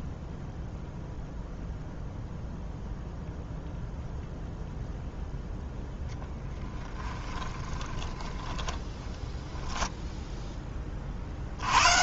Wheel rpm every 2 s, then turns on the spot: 0, 0, 0, 20, 10, 20.
6-10